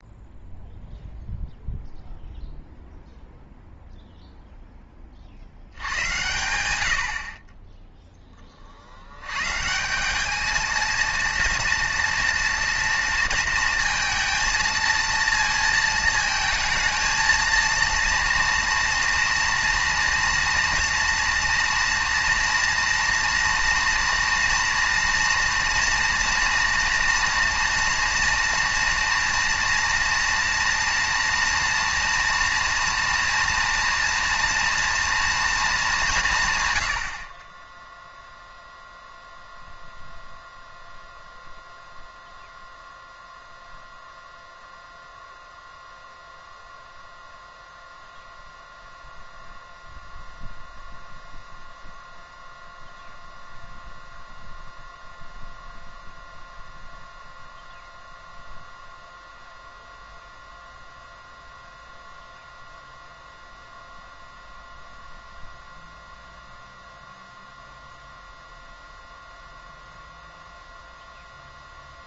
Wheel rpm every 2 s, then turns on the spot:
0, 0, 0, 90, 30, 210, 230, 230, 220, 230, 230, 230, 230, 240, 240, 230, 230, 230, 140, 0, 0, 0, 0, 0, 0, 0, 0, 0, 0, 0, 0, 0, 0, 0, 0, 0.
none